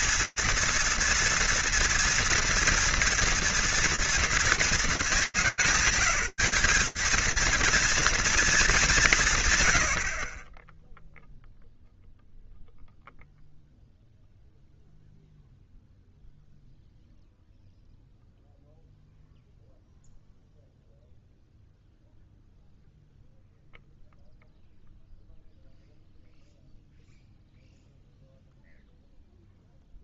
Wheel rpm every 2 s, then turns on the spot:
230, 230, 200, 200, 200, 0, 0, 0, 0, 0, 0, 0, 0, 0, 0.
none